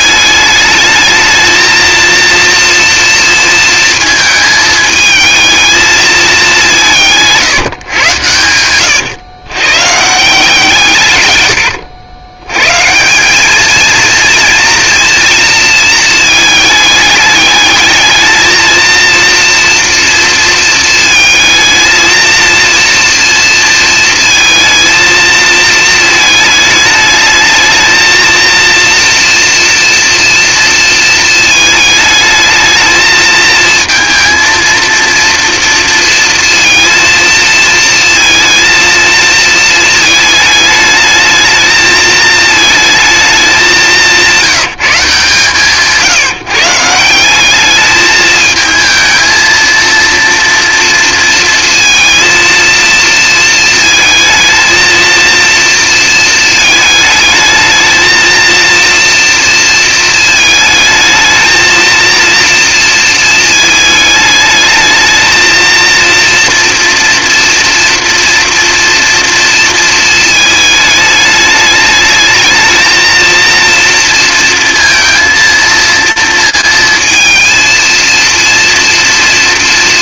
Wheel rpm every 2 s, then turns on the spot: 220, 230, 220, 200, 110, 130, 150, 230, 210, 230, 220, 230, 230, 220, 230, 230, 220, 230, 230, 230, 210, 220, 160, 160, 220, 230, 230, 230, 220, 230, 220, 230, 220, 230, 230, 220, 220, 230, 230, 220.
8-10